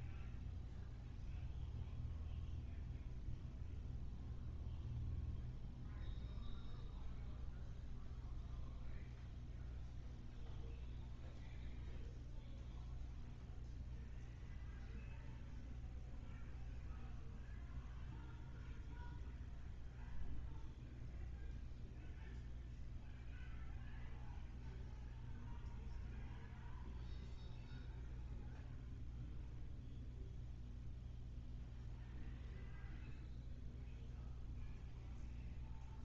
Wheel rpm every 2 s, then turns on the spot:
0, 0, 0, 0, 0, 0, 0, 0, 0, 0, 0, 0, 0, 0, 0, 0, 0, 0.
none